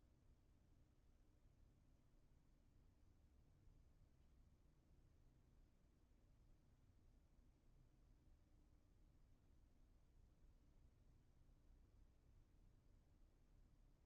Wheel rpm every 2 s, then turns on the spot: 0, 0, 0, 0, 0, 0, 0.
none